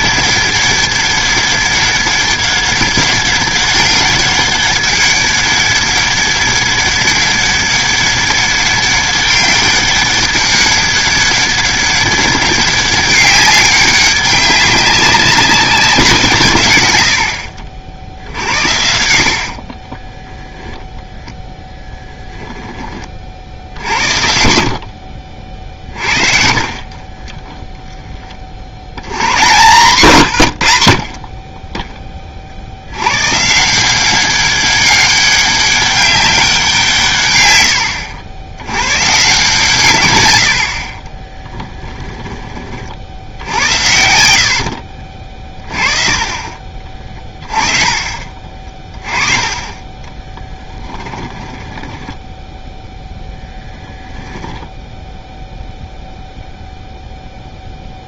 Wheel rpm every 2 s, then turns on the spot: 200, 200, 200, 200, 200, 200, 200, 190, 110, 70, 10, 20, 70, 40, 90, 80, 70, 200, 160, 110, 60, 50, 50, 30, 30, 20, 0, 0, 0.
18-20 24-26 44-48 50-52